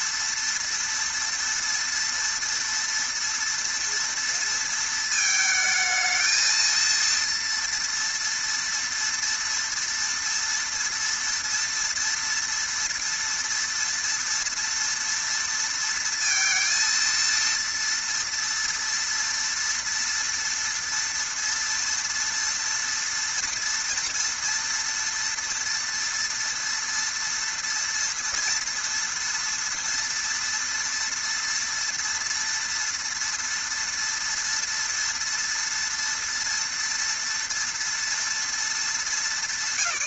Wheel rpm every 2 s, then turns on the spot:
230, 230, 230, 230, 230, 230, 230, 230, 230, 230, 230, 240, 240, 230, 230, 230, 230, 240, 230, 230.
none